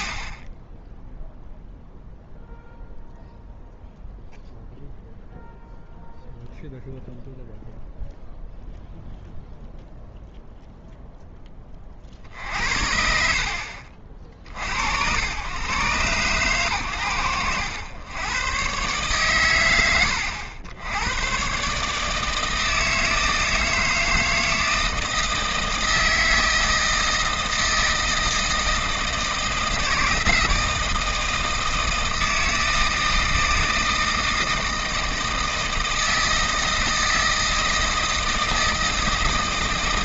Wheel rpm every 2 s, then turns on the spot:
10, 0, 0, 0, 0, 0, 50, 70, 120, 130, 90, 160, 160, 160, 160, 160, 160, 160, 160, 160.
none